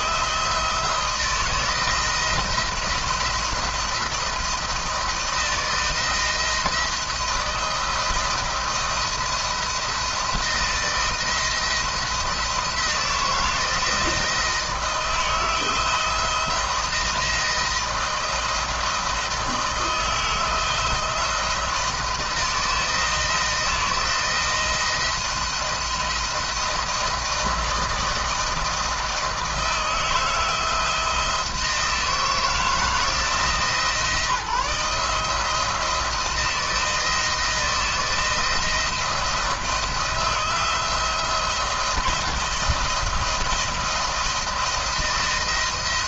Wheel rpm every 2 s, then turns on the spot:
160, 170, 170, 160, 170, 170, 160, 160, 170, 160, 170, 160, 170, 170, 160, 160, 170, 160, 170, 170, 170, 170, 170.
none